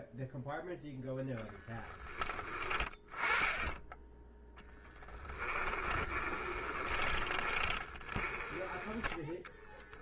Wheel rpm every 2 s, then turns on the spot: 0, 20, 20, 30, 10.
4-8